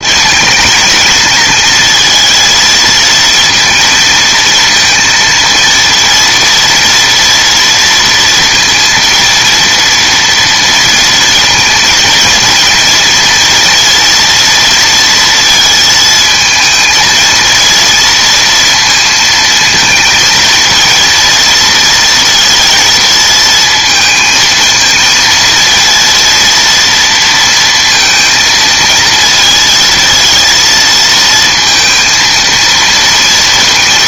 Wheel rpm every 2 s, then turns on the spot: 220, 230, 230, 230, 230, 230, 230, 230, 220, 230, 230, 230, 220, 230, 230, 230, 230.
none